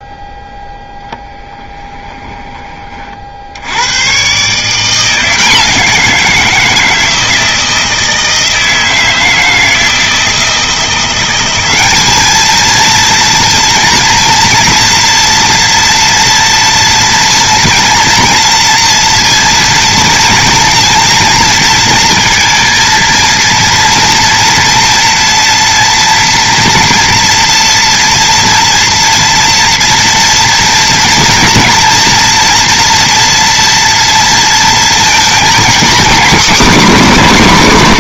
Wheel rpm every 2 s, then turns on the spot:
0, 30, 160, 170, 160, 170, 220, 230, 230, 230, 230, 230, 230, 230, 230, 230, 240, 230, 260.
none